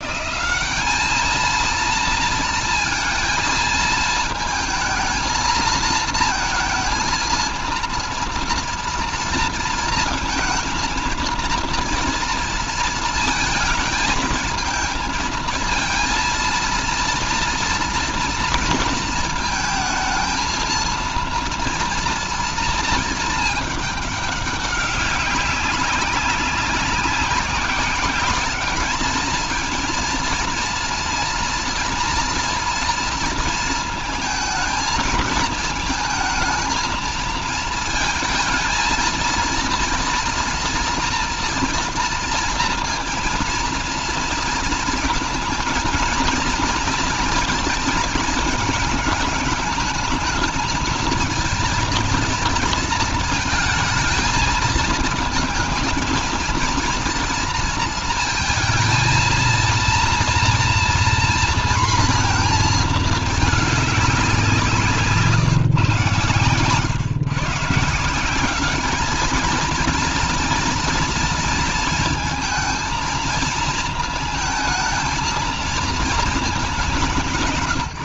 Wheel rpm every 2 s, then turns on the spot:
200, 230, 230, 230, 230, 220, 230, 230, 230, 230, 230, 230, 200, 190, 220, 230, 230, 220, 220, 230, 230, 230, 220, 230, 220, 220, 230, 220, 230, 230, 240, 220, 170, 120, 210, 230, 220, 220, 190.
none